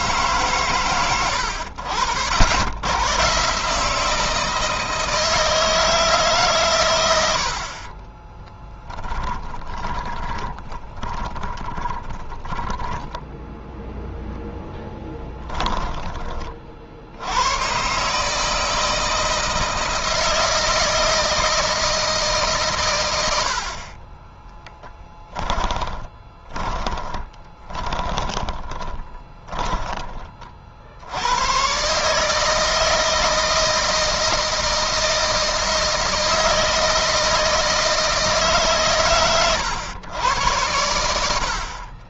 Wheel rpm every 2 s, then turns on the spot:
110, 90, 160, 120, 20, 20, 10, 10, 60, 160, 160, 130, 20, 20, 20, 60, 160, 160, 160, 150, 110.
8-16 24-30